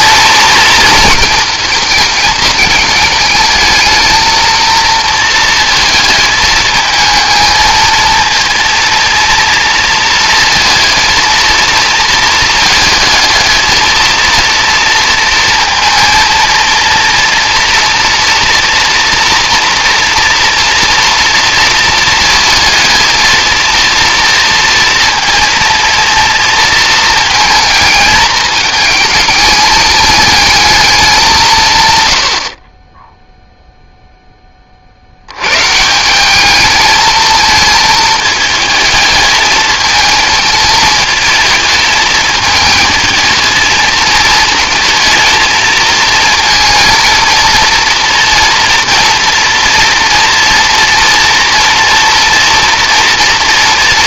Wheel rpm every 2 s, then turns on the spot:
230, 220, 230, 220, 230, 220, 220, 230, 230, 240, 230, 230, 230, 230, 220, 200, 10, 60, 220, 220, 220, 220, 230, 230, 230, 230, 230.
none